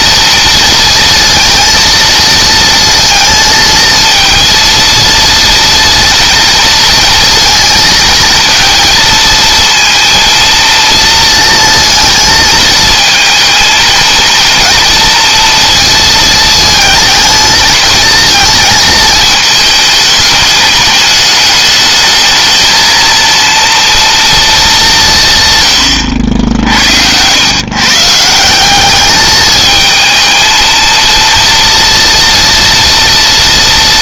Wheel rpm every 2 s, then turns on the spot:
230, 230, 230, 230, 230, 230, 220, 230, 220, 220, 210, 230, 180, 100, 210, 230, 230.
none